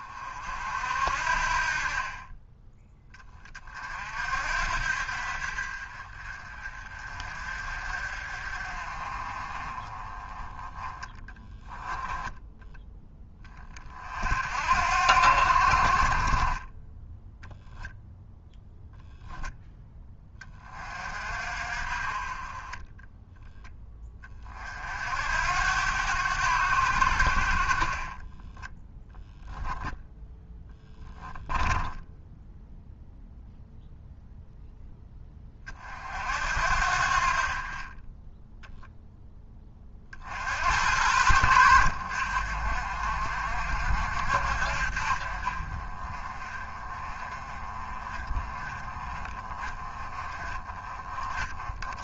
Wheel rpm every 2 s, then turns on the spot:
50, 10, 60, 40, 40, 10, 10, 70, 10, 0, 40, 10, 60, 80, 10, 10, 0, 10, 60, 10, 80, 60, 50, 30, 30, 30.
22-24 30-32